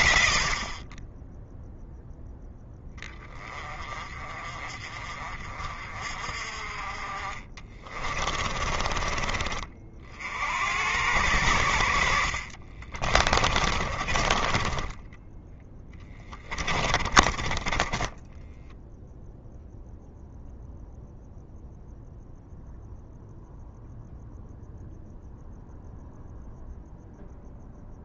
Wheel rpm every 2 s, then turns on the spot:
50, 10, 40, 40, 30, 80, 50, 30, 20, 10, 0, 0, 0, 0.
6-10 12-20